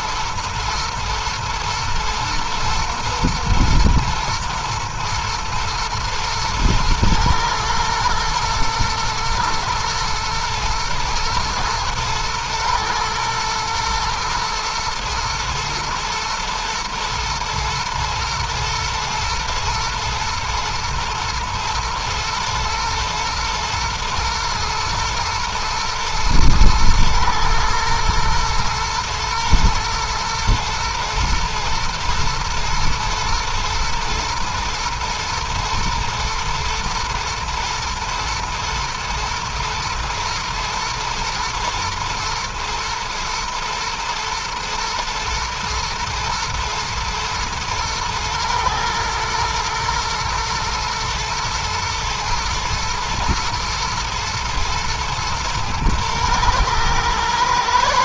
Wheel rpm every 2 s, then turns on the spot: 110, 120, 120, 120, 120, 120, 120, 110, 120, 120, 110, 110, 120, 110, 110, 110, 110, 110, 110, 120, 110, 110, 120, 110, 110, 120, 110, 110, 110.
none